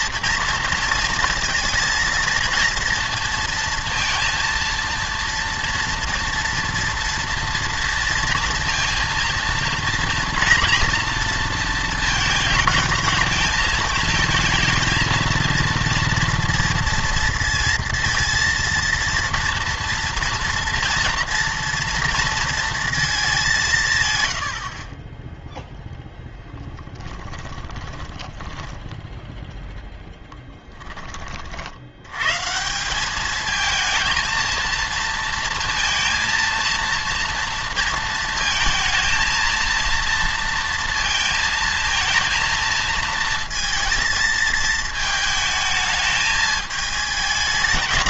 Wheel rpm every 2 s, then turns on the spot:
230, 230, 230, 230, 230, 230, 220, 230, 230, 230, 240, 230, 50, 10, 20, 10, 160, 230, 230, 230, 230, 230, 220, 210.
26-30